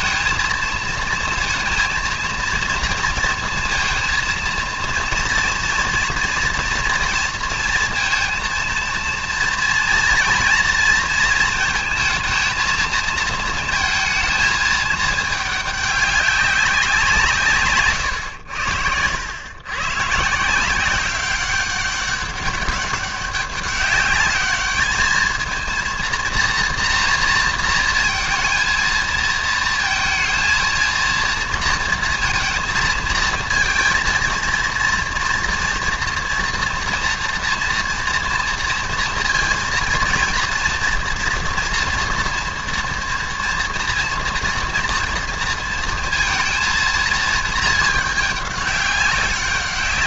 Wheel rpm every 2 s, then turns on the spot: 230, 230, 230, 230, 230, 230, 230, 220, 190, 100, 170, 190, 210, 230, 230, 230, 230, 230, 230, 230, 240, 230, 230, 230, 200.
none